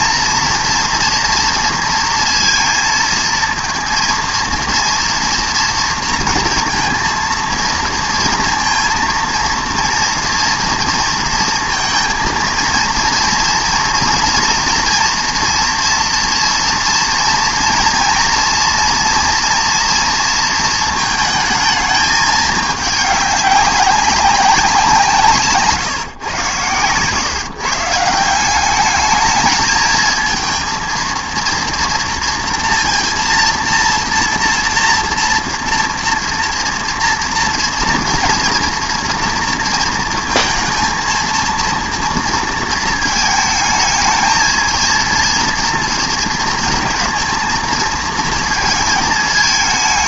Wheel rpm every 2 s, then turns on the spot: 240, 230, 230, 230, 230, 230, 230, 230, 230, 230, 230, 210, 190, 130, 180, 220, 230, 230, 230, 240, 230, 230, 220, 220, 230.
none